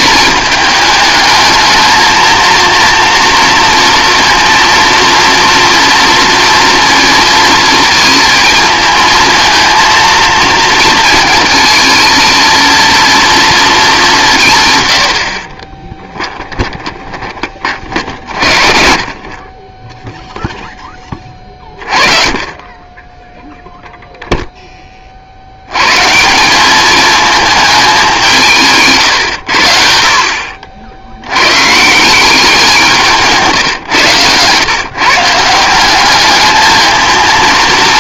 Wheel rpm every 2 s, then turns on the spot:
220, 230, 230, 230, 230, 230, 230, 140, 20, 60, 10, 30, 10, 190, 150, 50, 180, 130, 220.
16-18 28-30